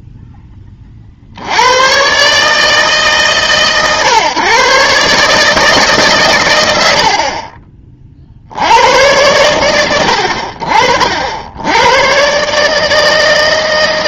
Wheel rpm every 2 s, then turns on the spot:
60, 130, 140, 40, 100, 90, 160.
6-8